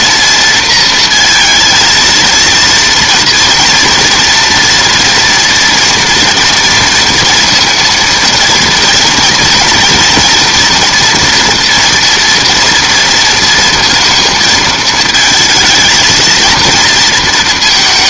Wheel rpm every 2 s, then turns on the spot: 230, 230, 230, 230, 240, 240, 230, 220, 220.
none